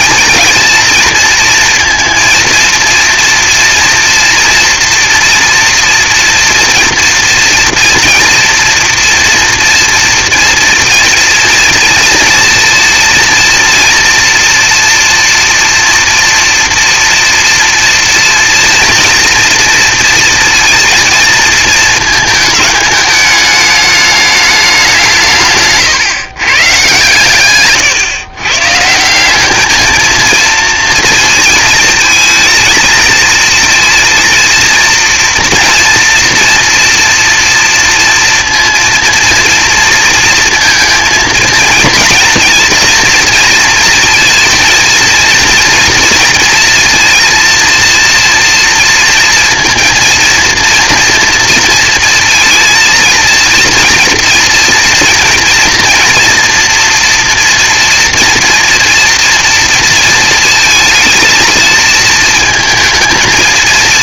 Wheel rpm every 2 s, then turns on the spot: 230, 230, 240, 230, 230, 230, 230, 240, 240, 230, 230, 220, 200, 130, 140, 230, 230, 230, 230, 230, 230, 230, 230, 230, 230, 230, 230, 230, 230, 240, 230, 230.
none